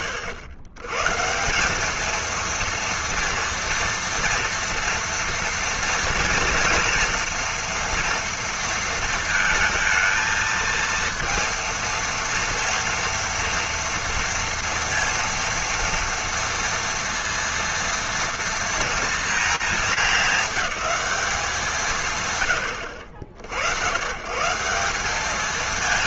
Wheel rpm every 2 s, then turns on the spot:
130, 230, 230, 230, 230, 230, 230, 230, 230, 230, 210, 80, 210.
none